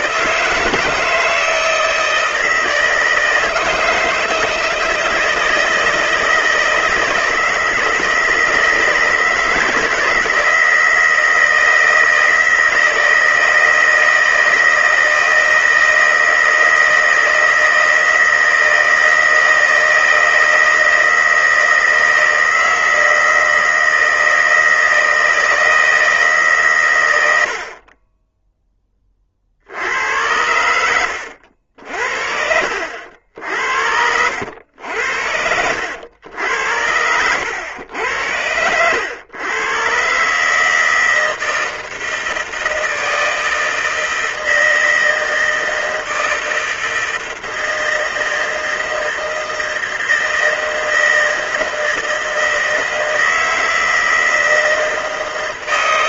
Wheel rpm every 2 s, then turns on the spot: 160, 160, 160, 160, 160, 160, 160, 160, 160, 160, 160, 160, 160, 140, 10, 90, 60, 80, 90, 90, 150, 160, 160, 160, 160, 160, 160, 160.
none